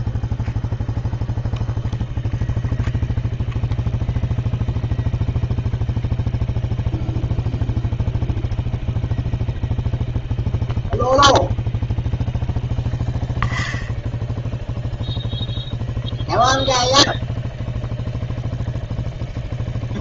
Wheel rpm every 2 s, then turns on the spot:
0, 0, 0, 0, 0, 0, 0, 0, 0, 0.
none